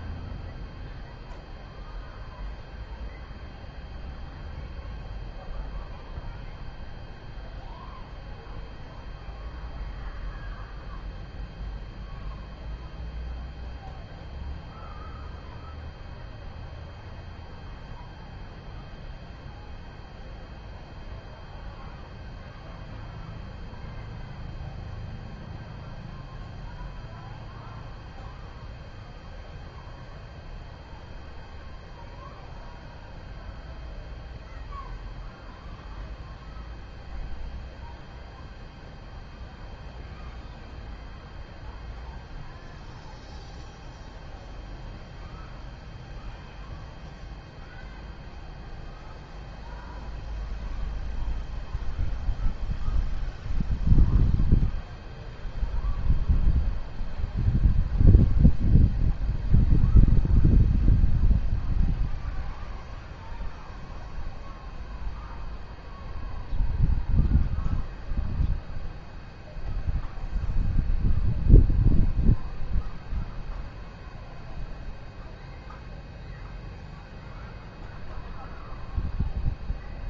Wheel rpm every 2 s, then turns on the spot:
0, 0, 0, 0, 0, 0, 0, 0, 0, 0, 0, 0, 0, 0, 0, 0, 0, 0, 0, 0, 0, 0, 0, 0, 0, 0, 0, 0, 0, 0, 0, 0, 0, 0, 0, 0, 0, 0, 0, 0.
none